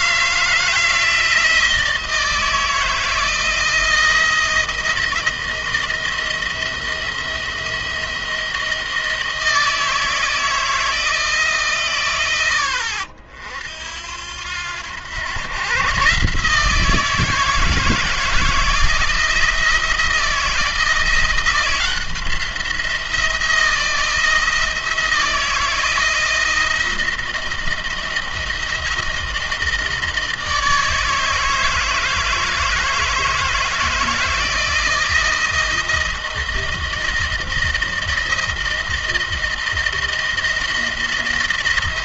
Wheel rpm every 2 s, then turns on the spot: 160, 160, 170, 170, 160, 160, 80, 90, 160, 160, 170, 170, 170, 170, 160, 160, 160, 160, 160, 160, 160.
none